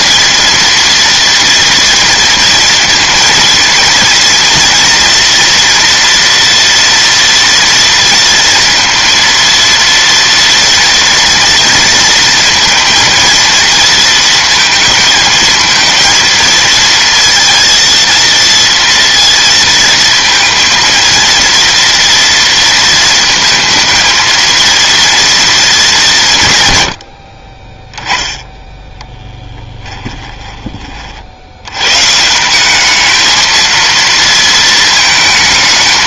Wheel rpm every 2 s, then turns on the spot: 230, 230, 230, 230, 230, 230, 230, 220, 230, 230, 230, 230, 230, 110, 10, 20, 190, 220.
none